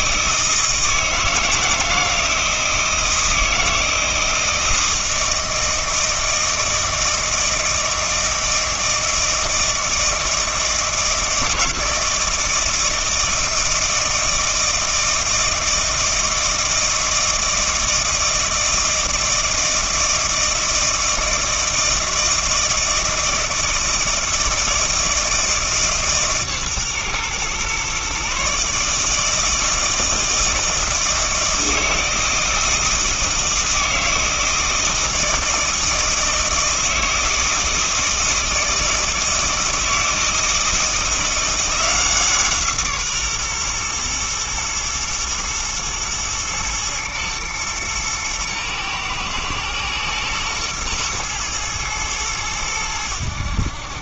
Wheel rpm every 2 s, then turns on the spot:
160, 160, 160, 160, 160, 160, 160, 160, 160, 160, 160, 160, 160, 140, 140, 160, 160, 160, 160, 160, 160, 160, 120, 110, 110, 110, 100.
none